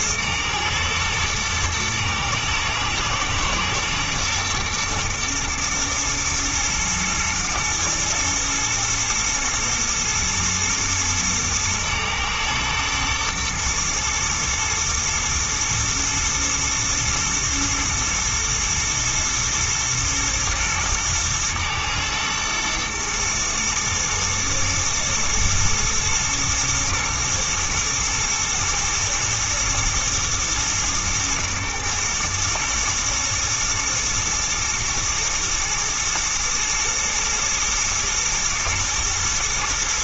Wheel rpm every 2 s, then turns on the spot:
120, 110, 120, 110, 120, 120, 110, 110, 110, 110, 120, 120, 120, 110, 110, 110, 120, 120, 120, 110.
none